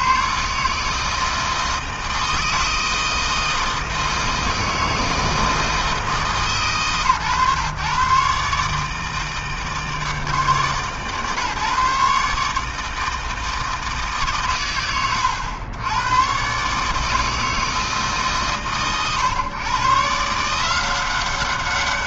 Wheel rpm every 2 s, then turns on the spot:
90, 160, 160, 160, 130, 150, 130, 160, 90, 160, 120.
none